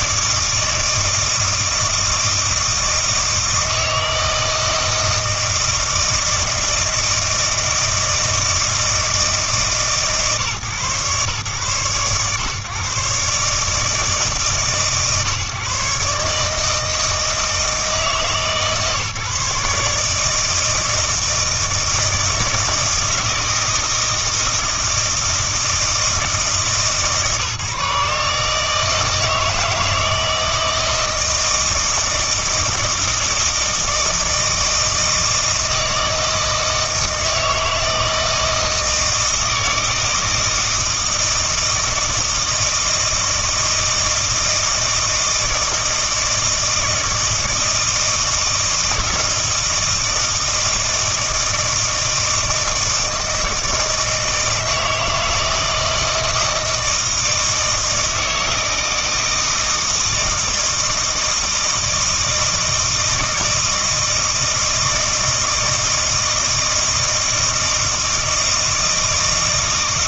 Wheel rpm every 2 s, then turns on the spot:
160, 160, 160, 160, 160, 140, 130, 140, 150, 150, 160, 160, 160, 160, 150, 170, 160, 160, 160, 160, 160, 160, 160, 160, 160, 160, 160, 160, 160, 160, 160, 160, 160, 160, 160.
none